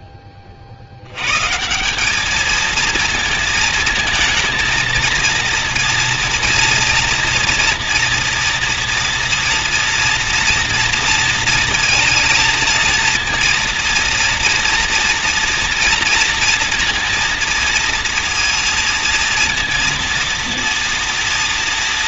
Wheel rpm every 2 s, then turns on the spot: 40, 220, 230, 230, 230, 230, 230, 240, 230, 230, 230.
none